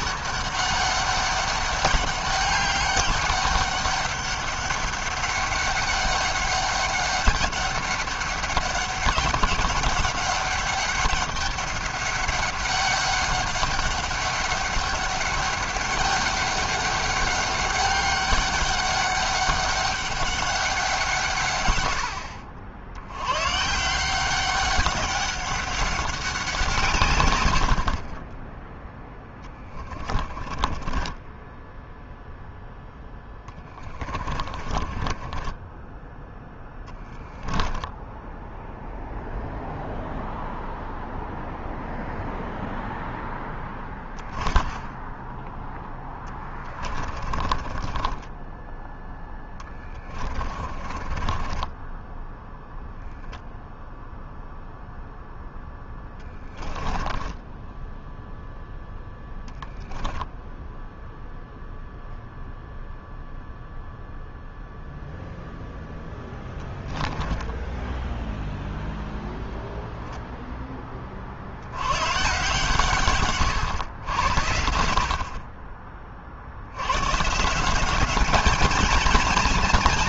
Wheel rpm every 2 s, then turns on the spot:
200, 200, 200, 200, 200, 200, 200, 200, 200, 200, 160, 100, 190, 130, 10, 20, 10, 30, 10, 0, 0, 0, 10, 30, 10, 30, 0, 0, 10, 0, 0, 0, 0, 10, 0, 50, 130, 40, 120, 180.
30-36 46-48 50-52 56-58 66-68